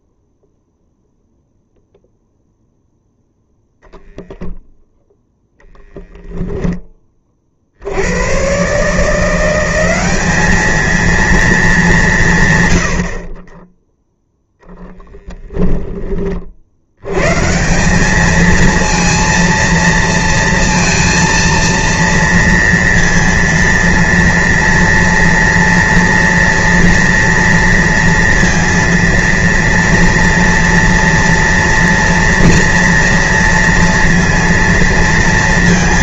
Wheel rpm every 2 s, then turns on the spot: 0, 0, 0, 0, 110, 210, 130, 0, 50, 220, 230, 230, 230, 240, 230, 230, 230, 230.
none